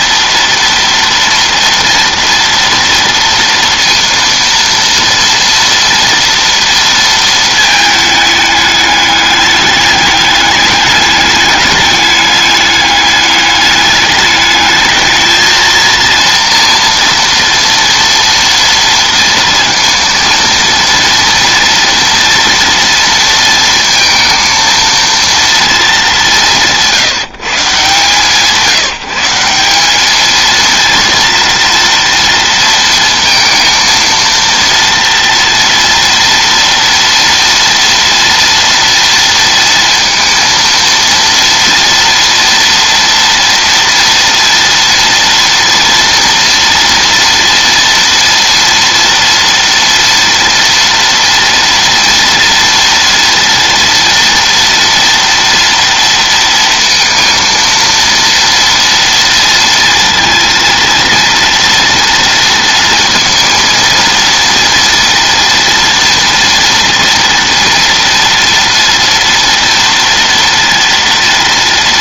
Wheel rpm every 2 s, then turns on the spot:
230, 230, 230, 230, 210, 210, 210, 210, 230, 230, 230, 230, 230, 160, 170, 230, 230, 230, 230, 230, 230, 230, 230, 230, 230, 230, 230, 230, 230, 230, 230, 230, 230, 230, 230, 230.
none